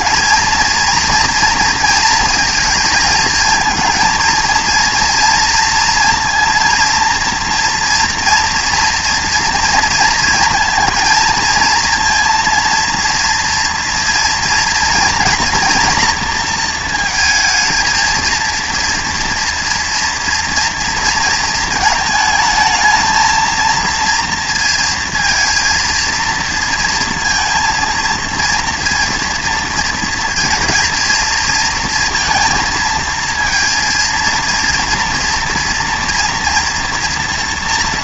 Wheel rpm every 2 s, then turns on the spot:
230, 220, 230, 230, 230, 230, 230, 240, 230, 230, 230, 220, 230, 230, 230, 230, 230, 230, 230.
none